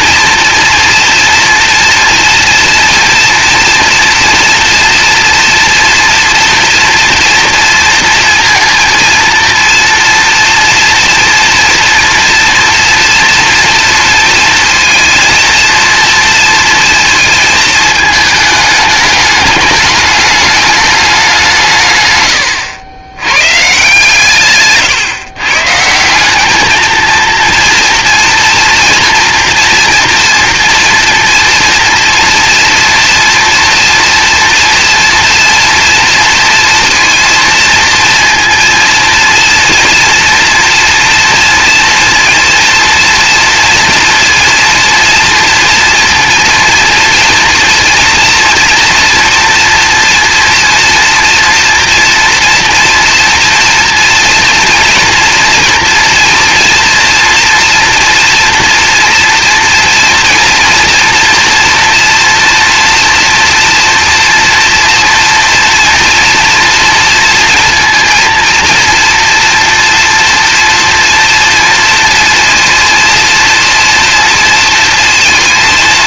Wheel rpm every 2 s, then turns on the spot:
230, 230, 230, 230, 230, 230, 240, 230, 230, 220, 210, 90, 140, 220, 240, 230, 230, 230, 230, 230, 230, 230, 230, 230, 230, 230, 230, 230, 230, 230, 230, 230, 230, 230, 230, 230, 230, 230.
none